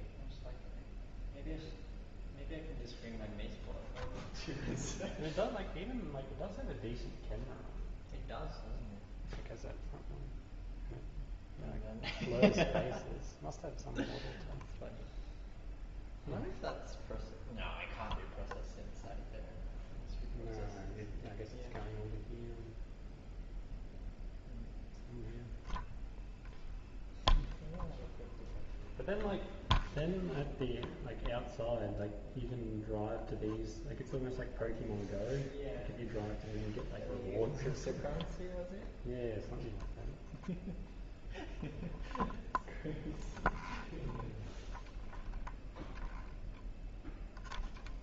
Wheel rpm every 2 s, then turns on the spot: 0, 0, 0, 0, 0, 0, 0, 0, 0, 0, 0, 0, 0, 0, 0, 0, 0, 0, 0, 0, 0, 0, 0, 0.
none